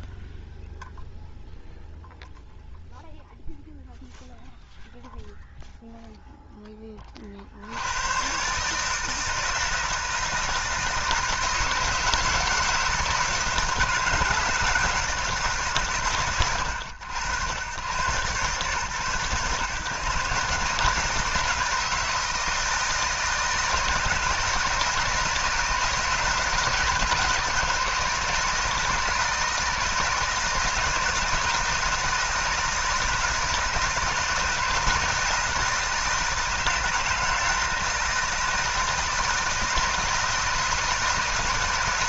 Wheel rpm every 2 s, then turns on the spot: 0, 0, 0, 10, 140, 160, 160, 160, 90, 120, 140, 160, 160, 160, 160, 160, 160, 160, 160, 160, 160.
none